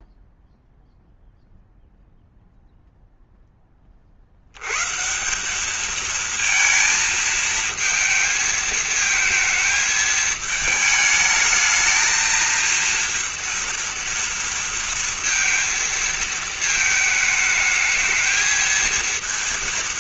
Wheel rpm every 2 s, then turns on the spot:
0, 0, 90, 230, 220, 220, 230, 230, 220, 220.
none